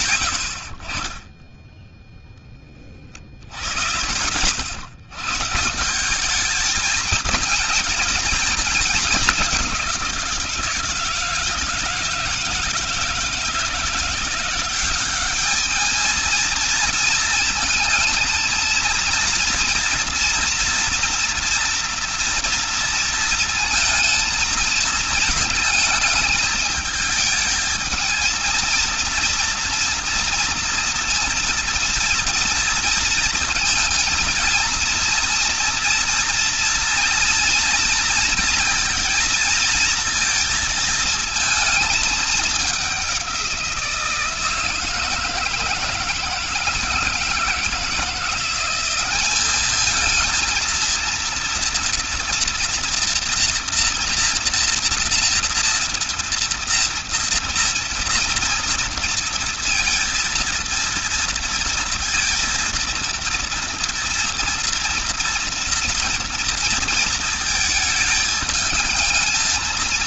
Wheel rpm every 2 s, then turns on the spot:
30, 70, 150, 220, 200, 160, 160, 210, 230, 230, 230, 230, 220, 220, 230, 230, 230, 230, 230, 230, 220, 170, 160, 160, 210, 230, 240, 230, 230, 230, 230, 230, 230, 220, 230.
none